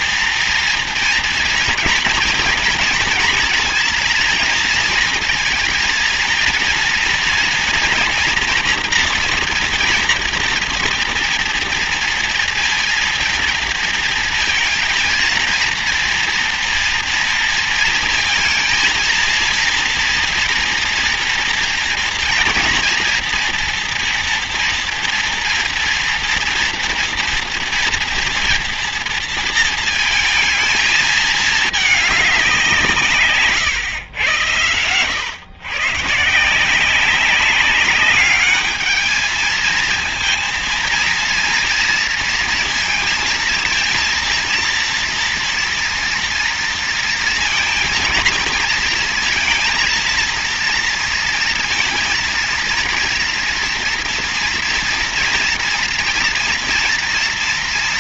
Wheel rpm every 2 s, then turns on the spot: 230, 230, 230, 230, 240, 230, 230, 230, 230, 230, 230, 230, 230, 230, 230, 220, 160, 110, 190, 220, 230, 230, 230, 230, 230, 230, 230, 230, 230.
none